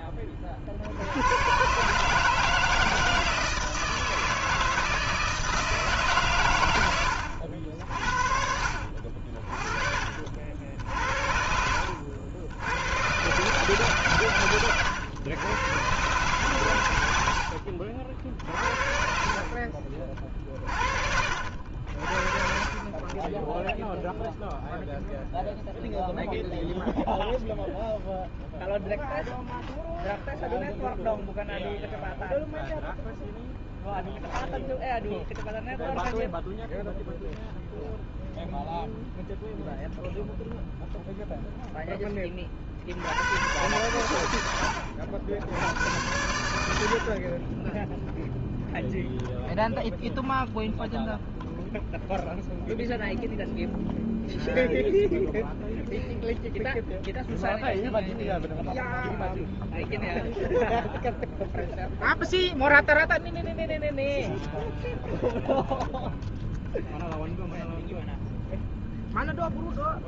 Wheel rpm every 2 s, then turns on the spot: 20, 160, 160, 130, 60, 50, 70, 120, 120, 60, 40, 40, 0, 0, 0, 0, 0, 0, 0, 0, 0, 70, 90, 70, 0, 0, 0, 0, 0, 0, 0, 0, 0, 0, 0.
8-10 14-16